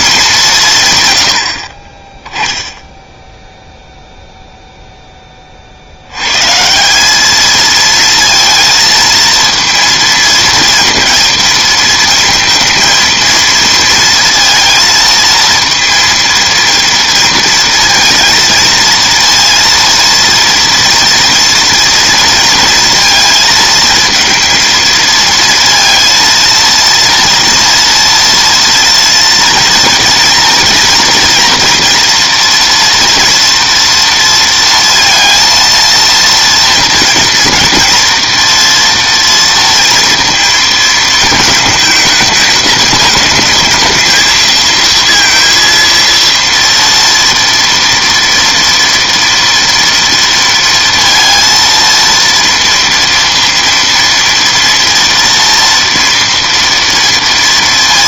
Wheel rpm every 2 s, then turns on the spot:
190, 10, 0, 150, 230, 230, 230, 230, 230, 230, 230, 230, 220, 230, 230, 230, 230, 230, 230, 230, 220, 210, 230, 230, 230, 230, 230, 230, 230.
none